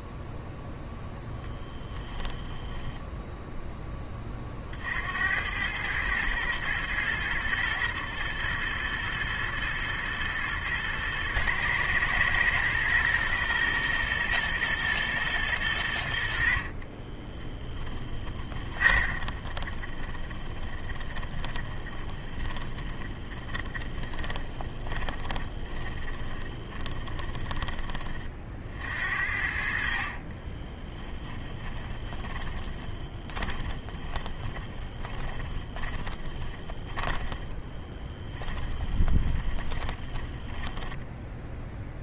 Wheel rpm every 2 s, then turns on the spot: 0, 10, 50, 110, 110, 110, 120, 120, 40, 20, 30, 30, 20, 20, 60, 20, 20, 20, 20, 20, 20.
18-28 30-42